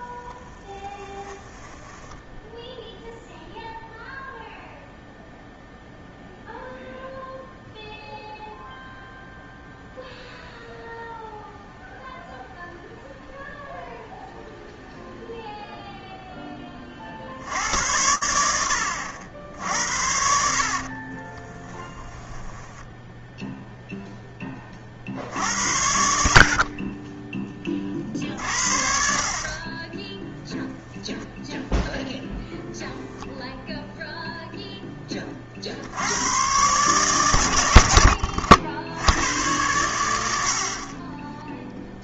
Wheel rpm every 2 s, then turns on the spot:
10, 0, 0, 0, 0, 0, 0, 0, 70, 80, 20, 0, 70, 30, 40, 0, 0, 40, 120, 100, 20.
0-2 20-22 40-42